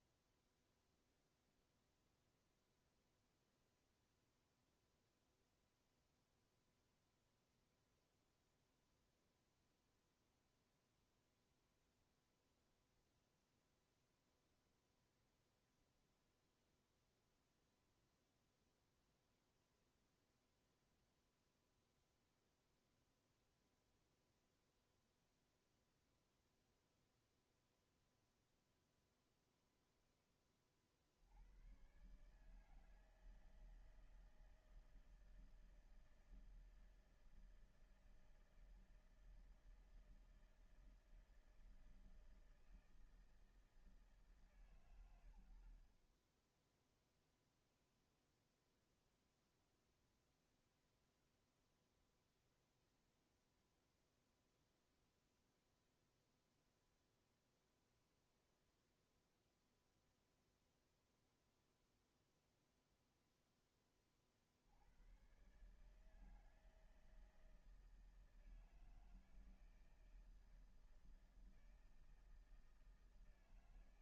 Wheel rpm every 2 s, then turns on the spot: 0, 0, 0, 0, 0, 0, 0, 0, 0, 0, 0, 0, 0, 0, 0, 40, 150, 160, 160, 160, 160, 160, 130, 10, 0, 0, 0, 0, 0, 0, 0, 0, 70, 160, 160, 160, 160.
none